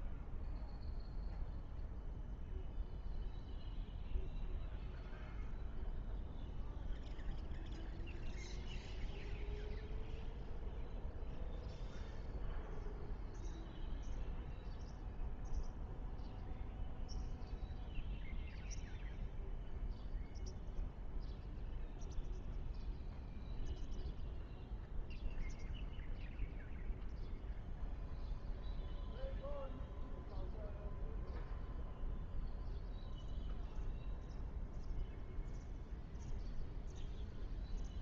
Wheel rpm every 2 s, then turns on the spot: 0, 0, 0, 0, 0, 0, 0, 0, 0, 0, 0, 0, 0, 0, 0, 0, 0, 0, 0.
none